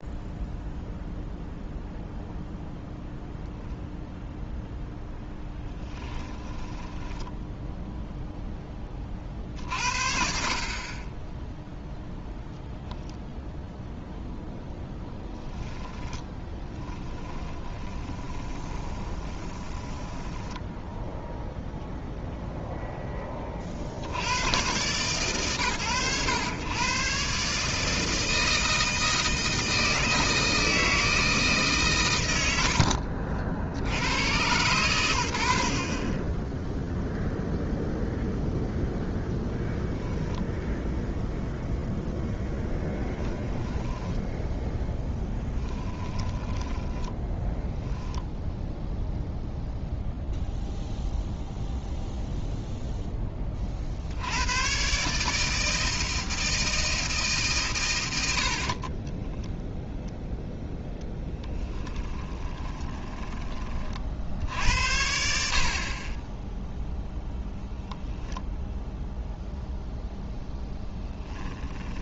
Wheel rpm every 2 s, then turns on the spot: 0, 0, 0, 10, 0, 40, 0, 0, 20, 10, 10, 0, 120, 110, 160, 160, 90, 120, 10, 0, 0, 10, 0, 10, 0, 0, 0, 100, 160, 70, 0, 20, 60, 0, 0, 10.
6-8 16-22 46-48 62-64 70-72